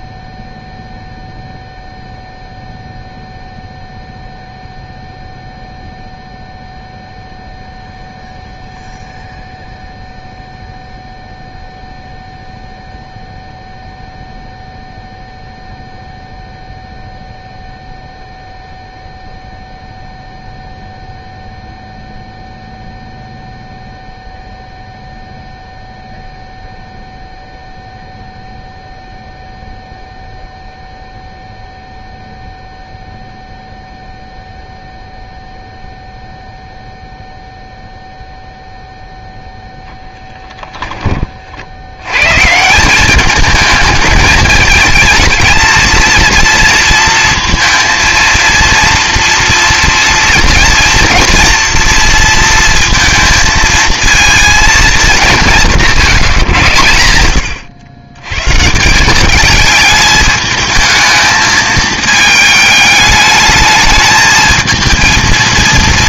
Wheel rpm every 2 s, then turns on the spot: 0, 0, 0, 0, 0, 0, 0, 0, 0, 0, 0, 0, 0, 0, 0, 0, 0, 0, 0, 0, 10, 160, 210, 230, 230, 230, 230, 220, 120, 150, 220, 210, 220.
40-42